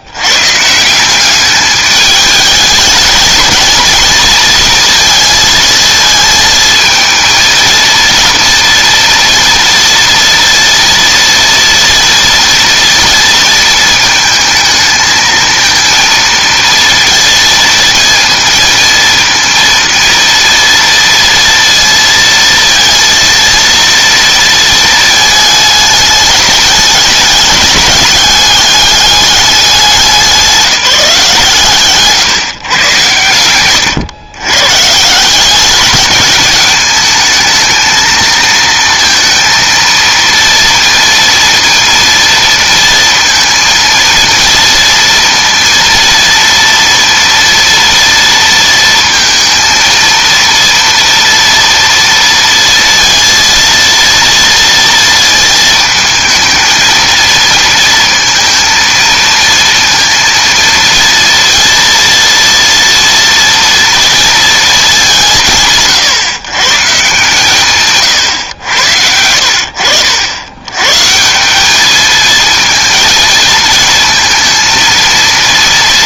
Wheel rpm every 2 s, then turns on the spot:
160, 210, 230, 220, 240, 230, 240, 220, 220, 230, 230, 230, 230, 210, 210, 180, 120, 130, 210, 220, 230, 230, 230, 230, 230, 240, 230, 230, 220, 230, 230, 230, 210, 130, 90, 120, 220, 230.
none